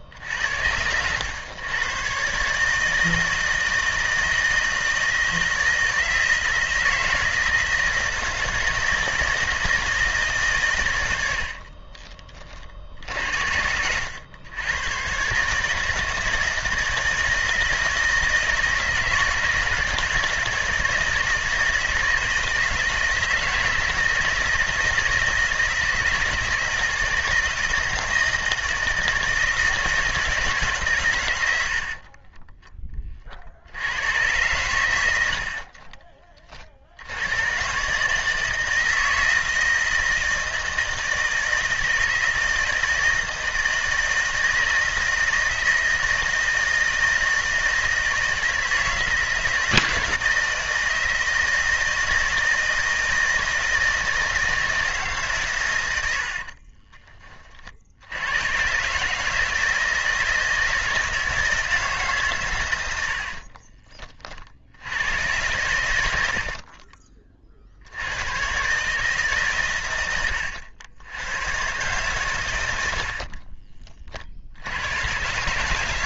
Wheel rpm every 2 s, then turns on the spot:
80, 150, 160, 160, 160, 120, 40, 110, 160, 160, 160, 160, 160, 160, 160, 150, 20, 110, 50, 160, 160, 160, 160, 160, 160, 160, 160, 160, 40, 120, 160, 100, 70, 50, 120, 100, 90, 80.
0-2 56-58 66-68